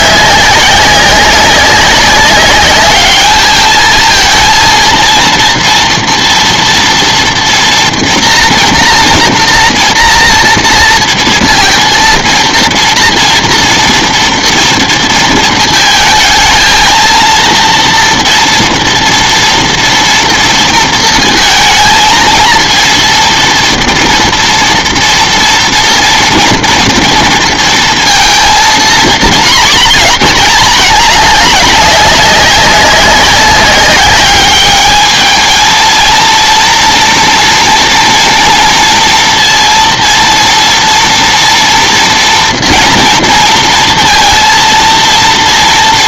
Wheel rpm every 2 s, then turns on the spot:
190, 200, 230, 240, 240, 230, 230, 230, 220, 230, 230, 230, 230, 230, 230, 210, 190, 210, 230, 230, 230, 230, 230.
none